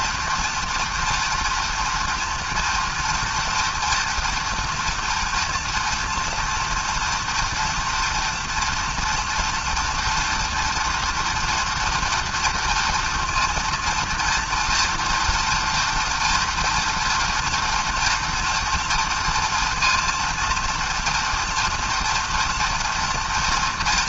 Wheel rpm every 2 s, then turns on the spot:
240, 230, 230, 230, 230, 230, 230, 230, 230, 230, 230, 230.
none